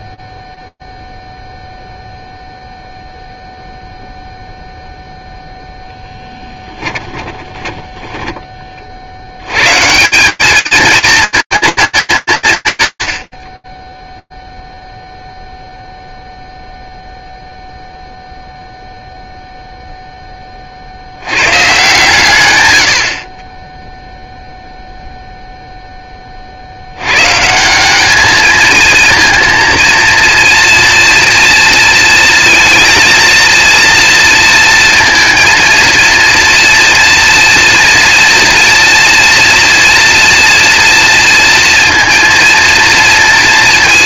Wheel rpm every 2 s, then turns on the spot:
30, 0, 0, 20, 30, 210, 150, 0, 0, 0, 60, 80, 0, 150, 230, 230, 230, 230, 230, 230, 230, 230.
6-8